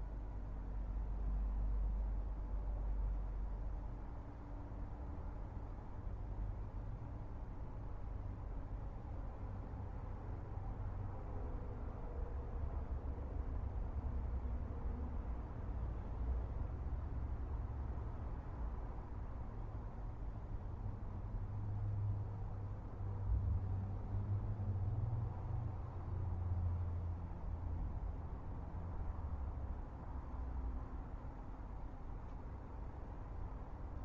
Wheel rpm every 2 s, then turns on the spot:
0, 0, 0, 0, 0, 0, 0, 0, 0, 0, 0, 0, 0, 0, 0, 0, 0.
none